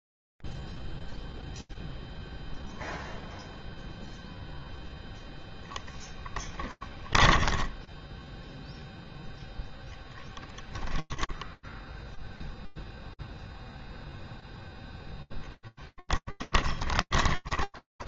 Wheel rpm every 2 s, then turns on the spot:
0, 0, 0, 10, 10, 0, 0, 0, 20.
6-10 16-18